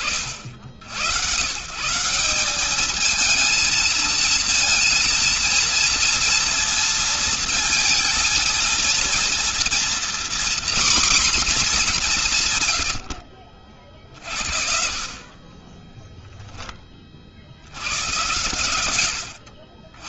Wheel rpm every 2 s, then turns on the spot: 80, 210, 230, 230, 220, 250, 100, 50, 20, 70.
none